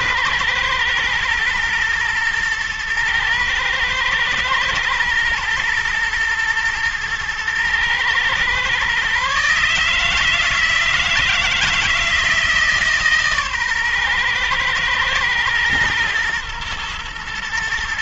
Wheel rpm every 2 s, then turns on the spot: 110, 110, 110, 120, 130, 160, 150, 110, 120.
none